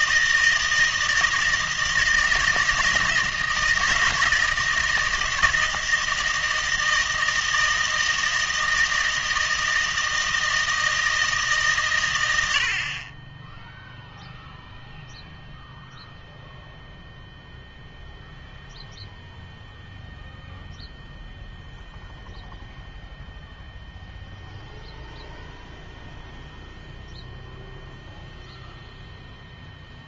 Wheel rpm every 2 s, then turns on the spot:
160, 160, 160, 160, 160, 160, 70, 0, 0, 0, 0, 0, 0, 0, 0.
none